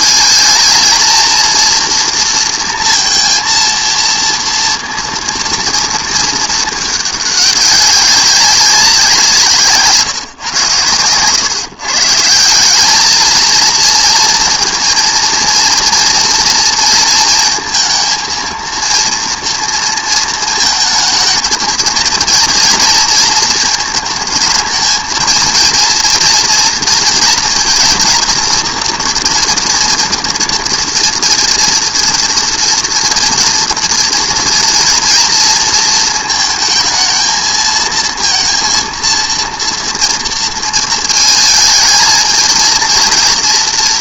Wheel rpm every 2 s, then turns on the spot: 220, 230, 230, 210, 190, 110, 190, 230, 230, 230, 220, 230, 220, 230, 230, 240, 230, 230, 220, 230, 230, 230.
none